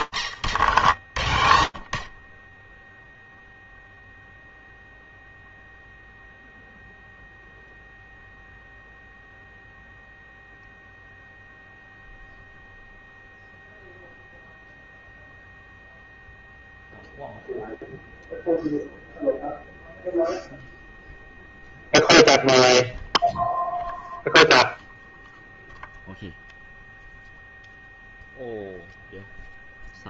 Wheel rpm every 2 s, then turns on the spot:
10, 0, 0, 0, 0, 0, 0, 0, 0, 0, 0, 0, 0, 0, 160.
none